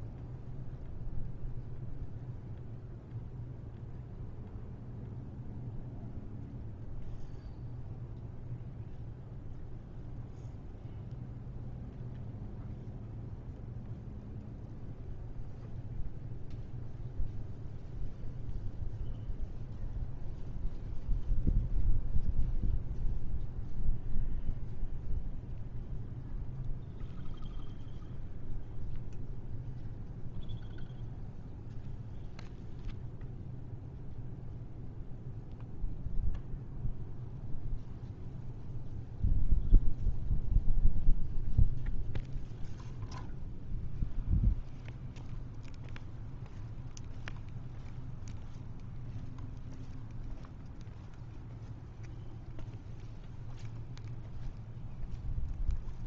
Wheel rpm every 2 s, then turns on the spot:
0, 0, 0, 0, 0, 0, 0, 0, 0, 0, 0, 0, 0, 0, 0, 0, 0, 0, 0, 0, 0, 0, 0, 0, 0, 0, 0, 0.
none